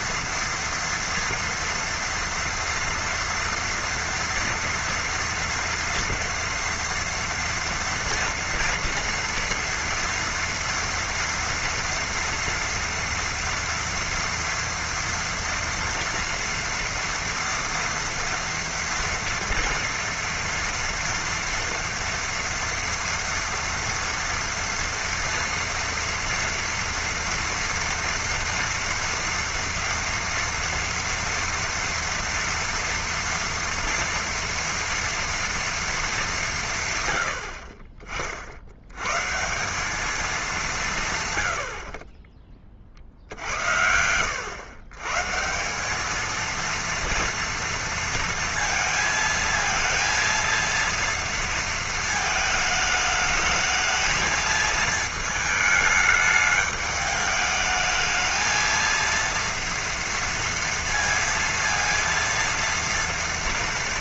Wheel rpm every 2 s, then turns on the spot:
230, 230, 230, 230, 230, 230, 230, 230, 230, 230, 230, 230, 230, 230, 230, 230, 230, 230, 180, 60, 210, 20, 100, 230, 230, 230, 220, 220, 210, 220, 230, 230.
none